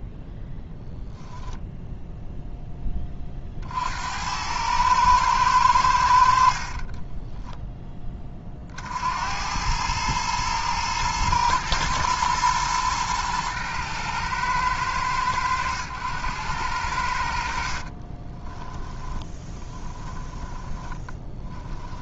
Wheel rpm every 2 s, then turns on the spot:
10, 100, 40, 50, 110, 120, 110, 90, 10, 10, 20.
4-6 16-22